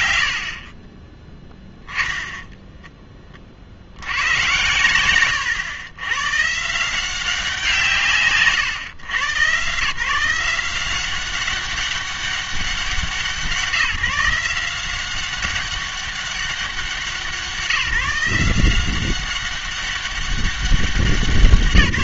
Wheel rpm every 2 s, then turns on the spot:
60, 10, 110, 140, 130, 180, 190, 180, 190, 180, 190.
none